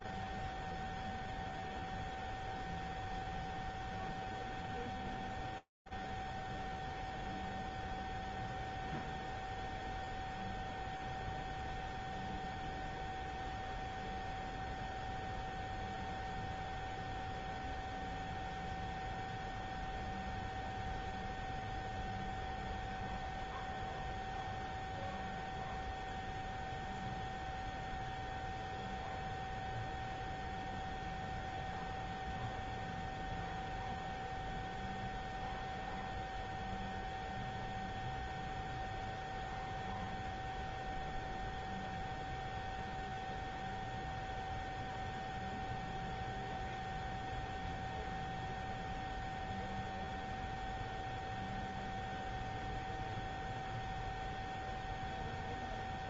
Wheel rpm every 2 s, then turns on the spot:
0, 0, 0, 0, 0, 0, 0, 0, 0, 0, 0, 0, 0, 0, 0, 0, 0, 0, 0, 0, 0, 0, 0, 0, 0, 0, 0, 0.
none